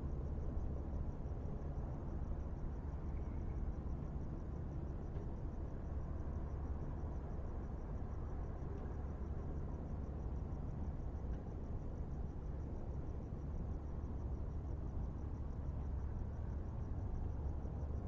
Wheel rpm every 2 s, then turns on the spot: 0, 0, 0, 0, 0, 0, 0, 0, 0.
none